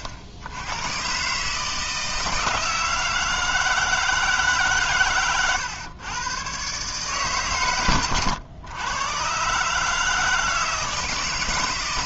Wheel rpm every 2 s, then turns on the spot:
90, 160, 140, 120, 110, 160.
none